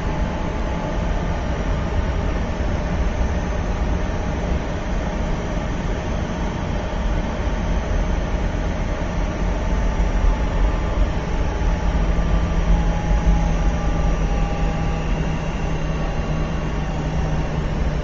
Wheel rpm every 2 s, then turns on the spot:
10, 0, 0, 0, 0, 0, 0, 0, 0.
none